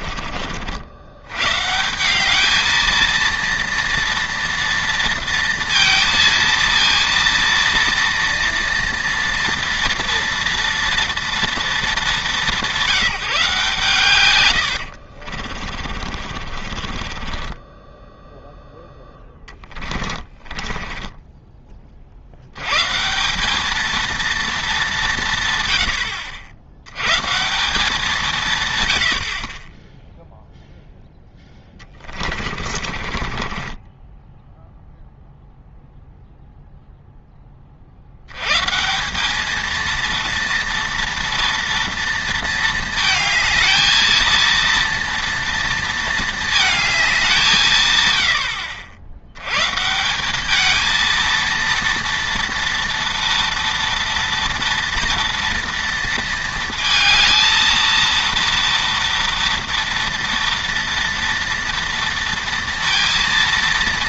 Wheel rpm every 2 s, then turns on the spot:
60, 220, 230, 230, 230, 230, 170, 120, 40, 0, 20, 130, 210, 90, 120, 0, 30, 0, 0, 110, 230, 220, 230, 220, 70, 210, 230, 230, 230, 230, 240, 230.
16-18 20-22 32-34